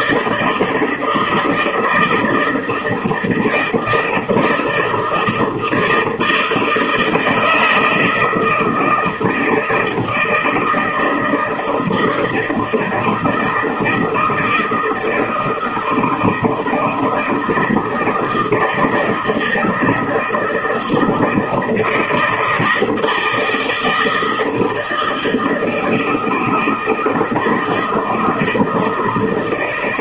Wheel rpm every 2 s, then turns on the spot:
160, 160, 170, 160, 160, 160, 160, 160, 160, 160, 160, 170, 160, 160, 160.
none